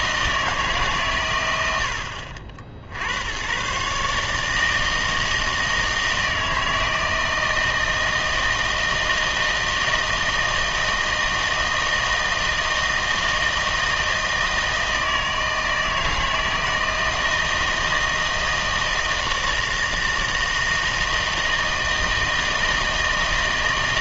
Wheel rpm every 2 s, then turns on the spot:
150, 60, 160, 160, 160, 160, 160, 160, 160, 160, 160, 160.
none